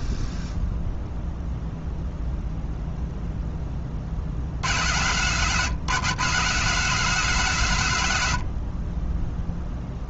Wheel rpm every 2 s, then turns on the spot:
0, 0, 110, 170, 40.
none